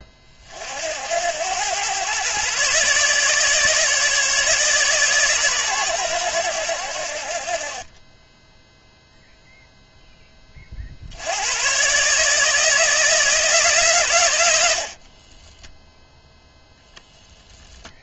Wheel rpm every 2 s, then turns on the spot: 70, 140, 140, 70, 0, 60, 160, 50, 0.
14-16